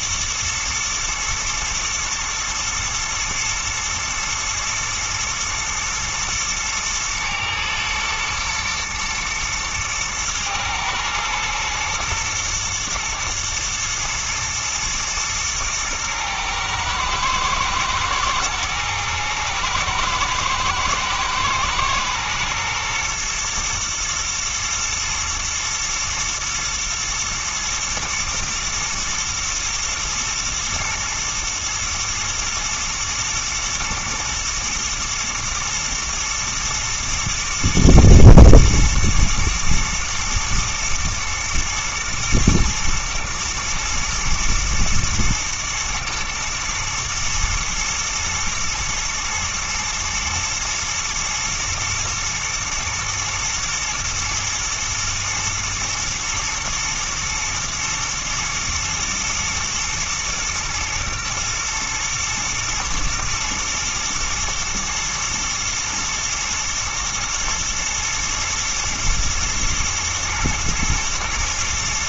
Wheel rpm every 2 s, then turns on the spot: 110, 110, 110, 110, 110, 110, 120, 120, 110, 110, 110, 120, 110, 120, 120, 120, 120, 110, 120, 120, 120, 120, 120, 110, 120, 120, 110, 110, 110, 110, 120, 120, 120, 120, 110, 120.
none